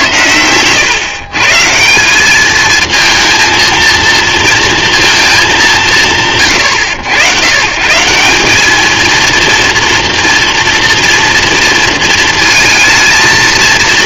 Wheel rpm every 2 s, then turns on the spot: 120, 220, 230, 90, 210, 230, 220.
none